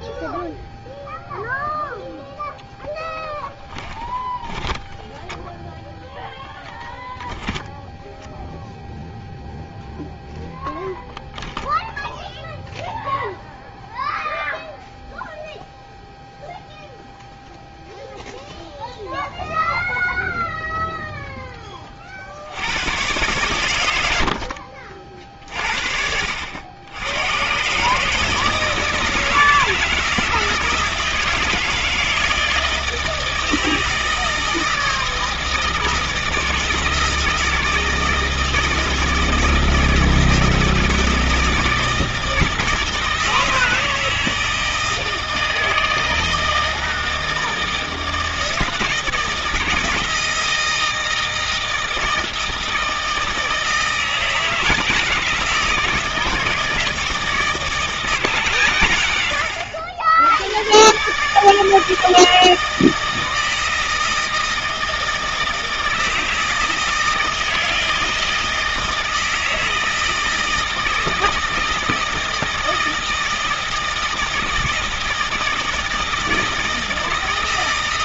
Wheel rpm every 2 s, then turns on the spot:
0, 0, 10, 0, 0, 0, 0, 0, 0, 0, 0, 90, 50, 80, 160, 160, 160, 160, 160, 160, 160, 160, 160, 160, 160, 160, 160, 160, 160, 140, 110, 160, 160, 160, 160, 160, 160, 160, 160.
4-6